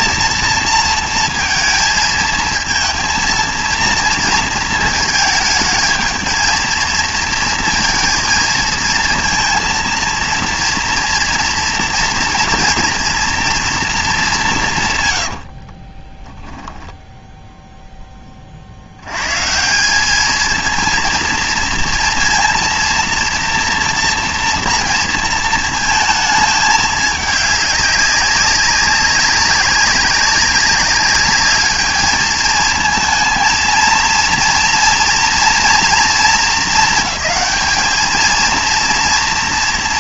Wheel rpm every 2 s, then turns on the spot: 230, 230, 220, 220, 220, 230, 230, 180, 10, 40, 230, 230, 230, 220, 200, 200, 220, 230, 220, 230.
none